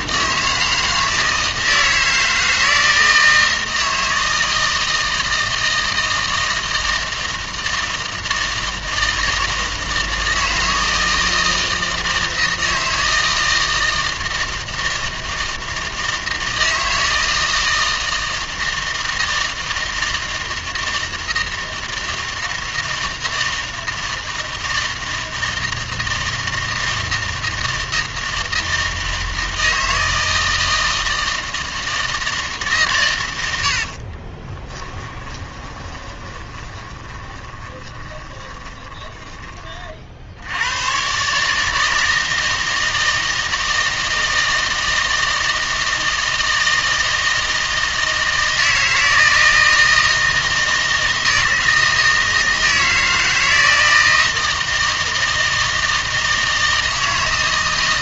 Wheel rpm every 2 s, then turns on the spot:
160, 160, 160, 160, 160, 160, 160, 160, 160, 160, 160, 160, 160, 160, 160, 160, 150, 20, 20, 20, 90, 160, 160, 160, 160, 160, 160, 160, 160.
34-40